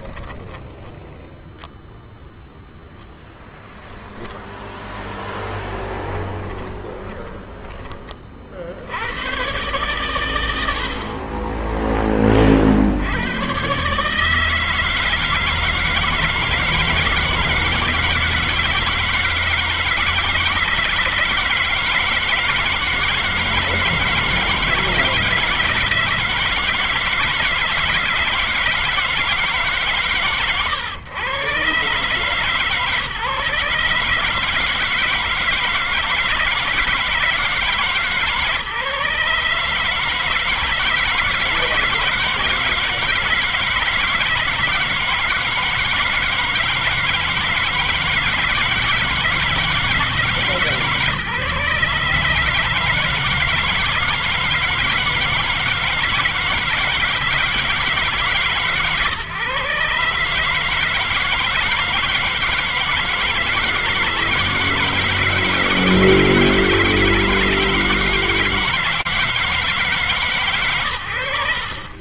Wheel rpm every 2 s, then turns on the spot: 0, 0, 10, 30, 110, 20, 150, 160, 160, 160, 160, 160, 160, 160, 140, 150, 150, 160, 150, 160, 160, 160, 160, 160, 150, 140, 160, 170, 150, 140, 160, 160, 150, 160, 160, 100.
4-6